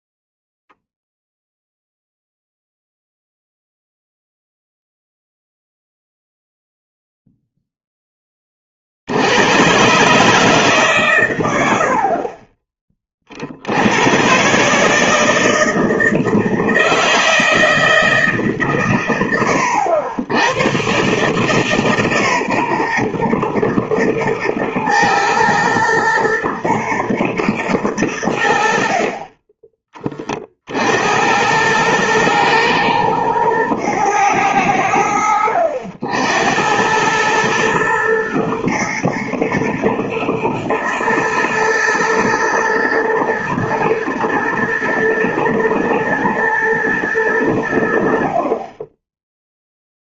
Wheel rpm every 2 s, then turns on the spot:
0, 0, 0, 0, 50, 140, 30, 150, 160, 120, 120, 130, 110, 120, 50, 60, 120, 90, 90, 110, 110, 110, 110, 110, 20.
none